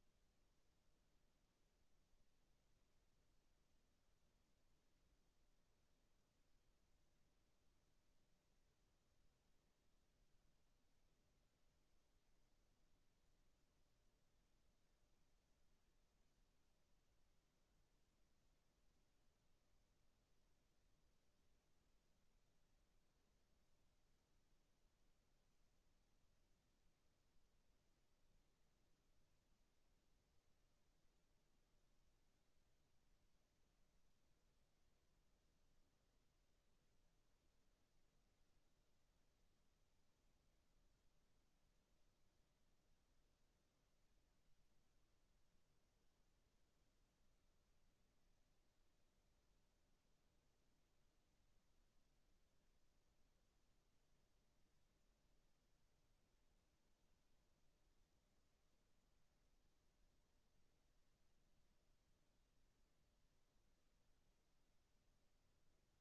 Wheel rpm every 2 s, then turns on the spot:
0, 0, 0, 0, 0, 0, 0, 0, 0, 0, 0, 0, 0, 0, 0, 0, 0, 0, 0, 0, 0, 0, 0, 0, 0, 0, 0, 0, 0, 0, 0, 0, 0.
none